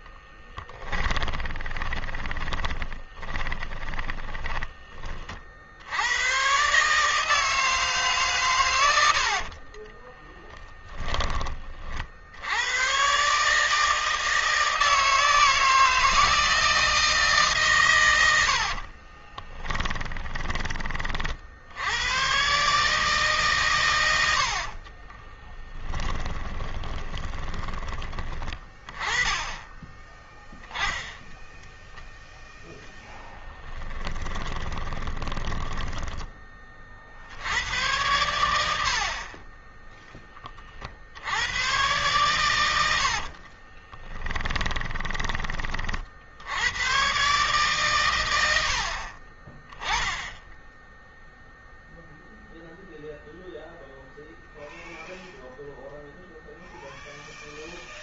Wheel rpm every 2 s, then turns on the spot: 20, 20, 30, 150, 80, 20, 140, 160, 150, 40, 50, 140, 20, 20, 20, 0, 10, 30, 60, 40, 80, 60, 20, 130, 50, 0, 0, 0, 0.
0-4 8-10 18-20 24-28 32-36 42-46